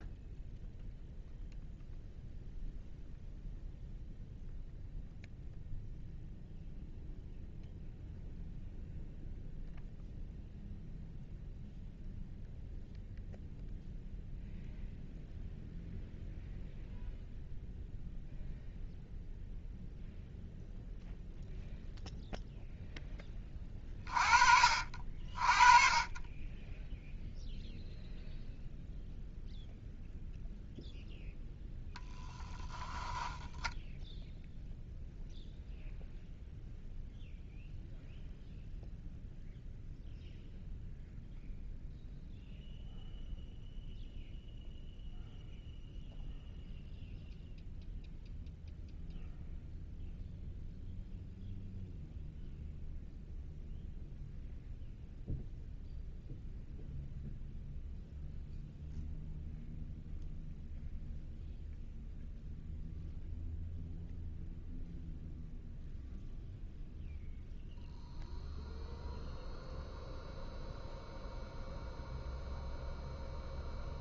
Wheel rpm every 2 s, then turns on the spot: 0, 0, 0, 0, 0, 0, 0, 0, 0, 0, 0, 10, 40, 0, 0, 0, 0, 0, 0, 0, 0, 0, 0, 0, 0, 0, 0, 0, 0, 0, 0, 0, 0, 0, 0, 0, 0.
none